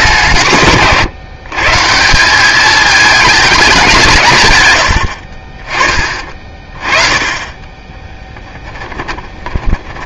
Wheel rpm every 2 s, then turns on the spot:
150, 200, 100, 30, 10.
8-10